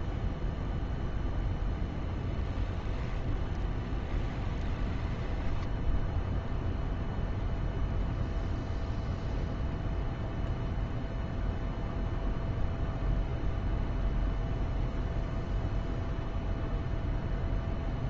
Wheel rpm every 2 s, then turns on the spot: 0, 10, 10, 0, 0, 0, 0, 0, 0.
2-6